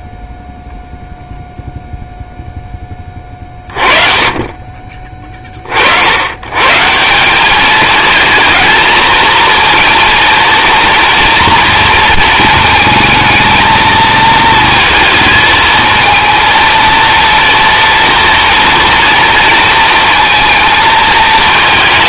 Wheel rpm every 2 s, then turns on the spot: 0, 10, 30, 130, 220, 230, 220, 220, 220, 230, 220.
none